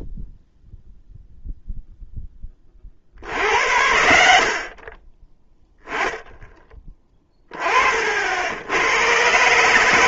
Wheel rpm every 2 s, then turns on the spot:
0, 20, 60, 10, 80.
none